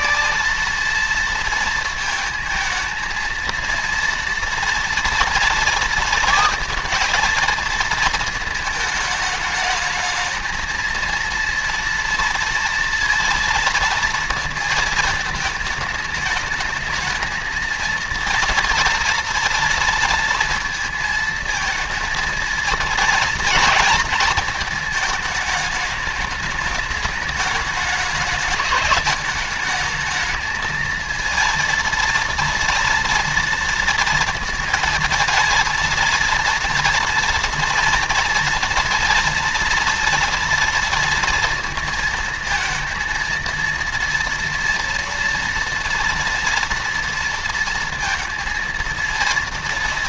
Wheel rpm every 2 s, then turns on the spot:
230, 230, 230, 230, 220, 230, 230, 220, 220, 230, 230, 230, 220, 210, 210, 220, 230, 230, 230, 240, 230, 230, 240, 230, 230.
none